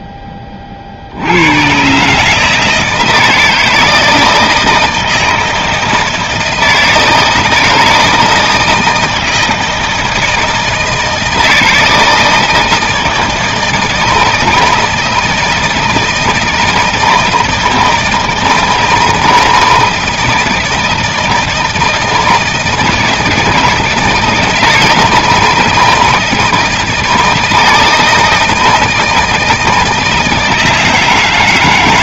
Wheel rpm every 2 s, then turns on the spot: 20, 150, 160, 160, 160, 160, 160, 160, 160, 160, 160, 160, 170, 160, 160, 160.
none